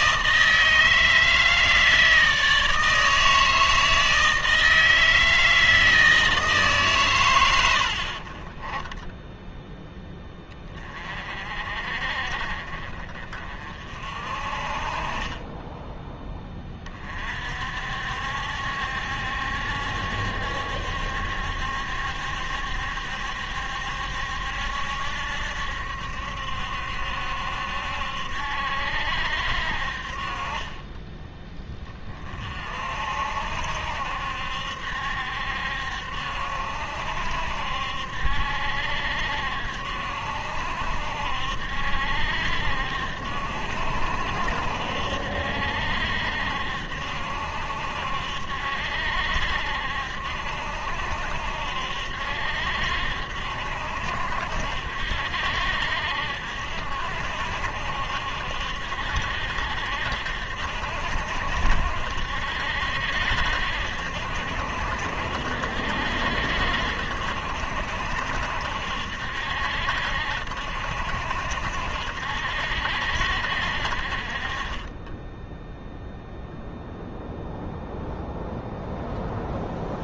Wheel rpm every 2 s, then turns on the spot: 160, 160, 160, 150, 20, 20, 40, 40, 20, 70, 70, 70, 70, 70, 70, 20, 50, 70, 70, 70, 70, 70, 60, 70, 70, 70, 70, 60, 70, 60, 70, 70, 70, 70, 70, 70, 70, 30, 0, 0.
none